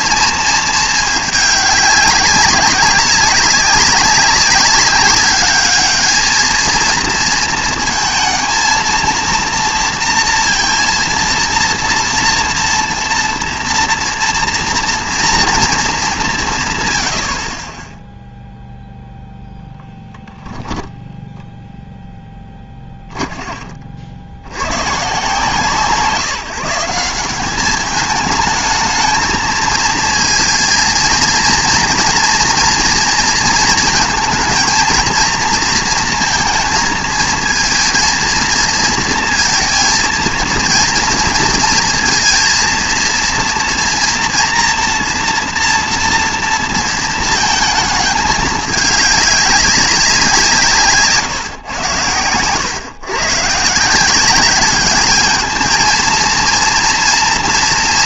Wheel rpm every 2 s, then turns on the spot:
220, 190, 200, 220, 230, 230, 240, 230, 160, 0, 10, 20, 80, 170, 220, 230, 230, 230, 230, 220, 230, 230, 230, 230, 210, 160, 120, 200, 230.
20-24